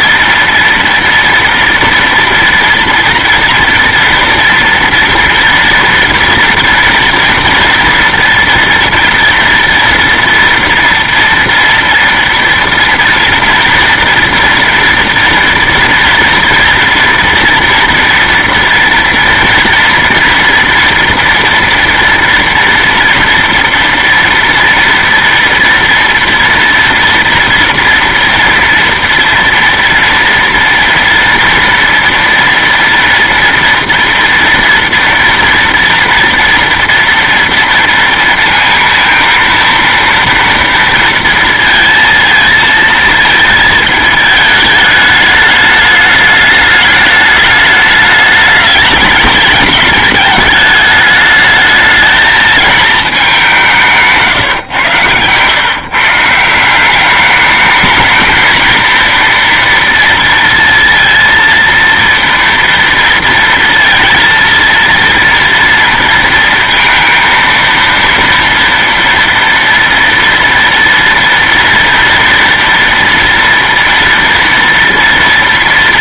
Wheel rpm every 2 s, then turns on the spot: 230, 230, 230, 230, 230, 230, 230, 240, 230, 230, 230, 230, 230, 240, 230, 230, 230, 230, 230, 230, 230, 230, 220, 210, 210, 210, 220, 140, 160, 220, 230, 230, 230, 230, 230, 230, 230, 230.
none